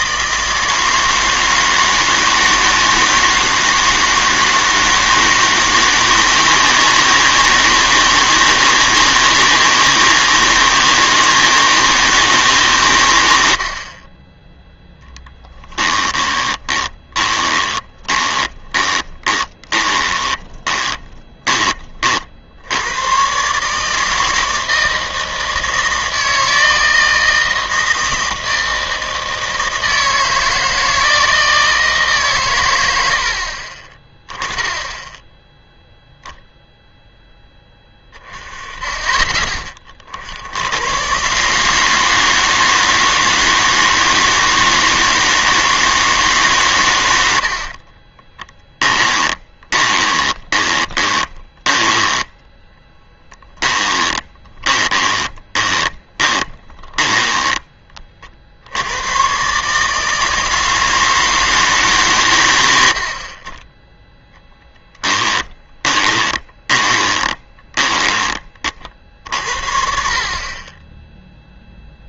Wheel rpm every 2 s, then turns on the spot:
160, 160, 160, 160, 160, 160, 130, 10, 20, 20, 10, 80, 160, 160, 160, 160, 100, 10, 0, 20, 90, 160, 160, 130, 10, 20, 10, 20, 10, 80, 160, 90, 10, 20, 50, 20.
16-22 48-58 64-68